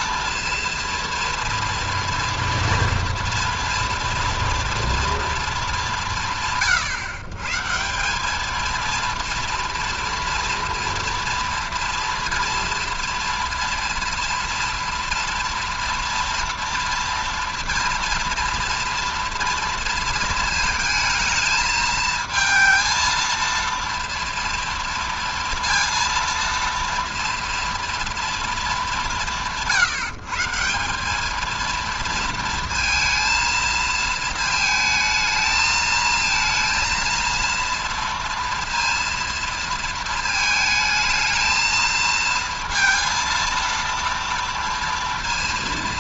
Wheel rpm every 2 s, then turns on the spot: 230, 230, 230, 130, 220, 230, 230, 230, 230, 230, 220, 220, 230, 230, 220, 170, 230, 220, 230, 230, 220, 230, 230.
none